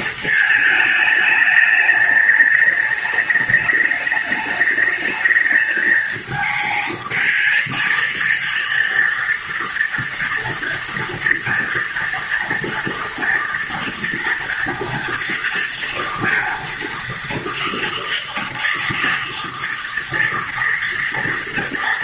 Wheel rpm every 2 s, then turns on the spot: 220, 210, 210, 220, 230, 230, 230, 230, 230, 230, 230.
none